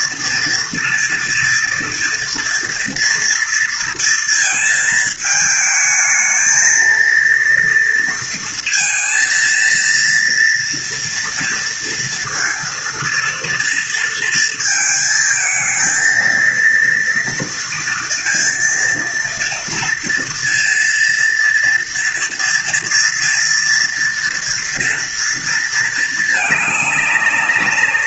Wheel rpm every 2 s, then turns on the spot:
230, 230, 220, 230, 230, 230, 230, 220, 230, 230, 230, 240, 230, 210.
none